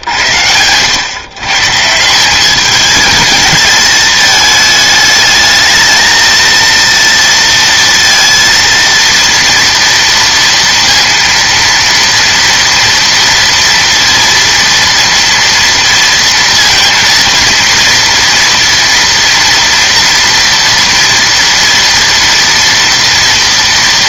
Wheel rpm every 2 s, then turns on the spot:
110, 210, 220, 230, 230, 230, 230, 230, 230, 230, 230, 230.
none